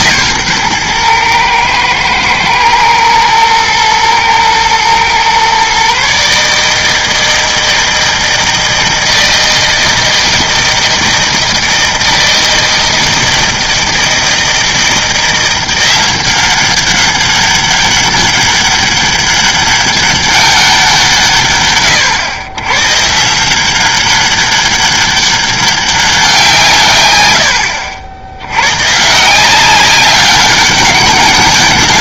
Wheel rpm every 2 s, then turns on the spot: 120, 110, 120, 160, 160, 160, 160, 160, 190, 200, 190, 130, 200, 150, 120, 190.
none